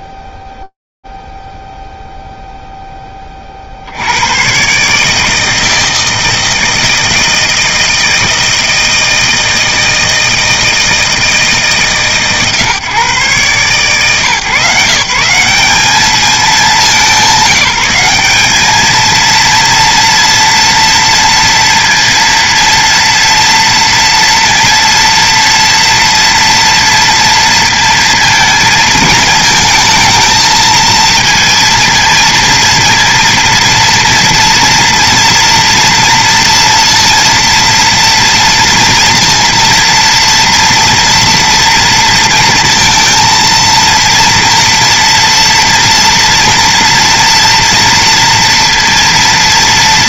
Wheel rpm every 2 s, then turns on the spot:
0, 0, 60, 160, 160, 160, 150, 130, 200, 180, 230, 230, 230, 230, 230, 220, 230, 230, 230, 230, 230, 230, 230, 230, 230.
none